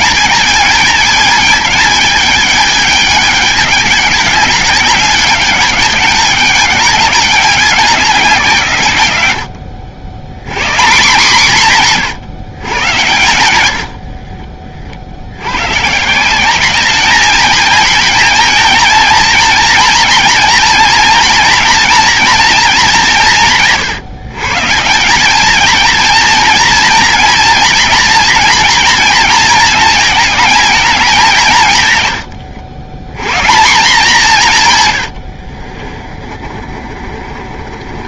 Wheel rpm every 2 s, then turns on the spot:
220, 220, 200, 200, 170, 120, 140, 40, 190, 220, 230, 230, 160, 230, 230, 220, 100, 180, 20.
14-16 32-34 36-38